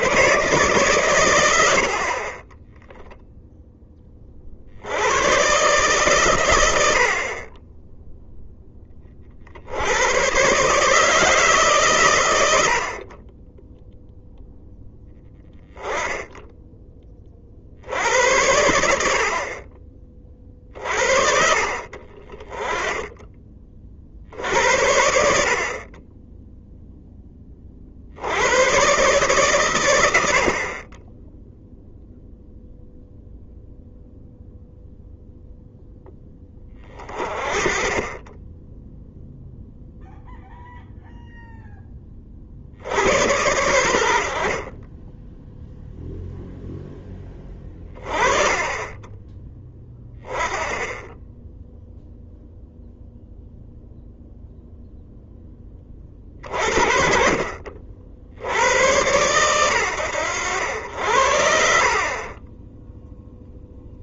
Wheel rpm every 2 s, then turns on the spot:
140, 20, 70, 90, 20, 140, 90, 0, 10, 80, 60, 20, 70, 0, 110, 40, 0, 0, 20, 10, 0, 70, 40, 10, 20, 10, 0, 0, 40, 100, 70, 10.
none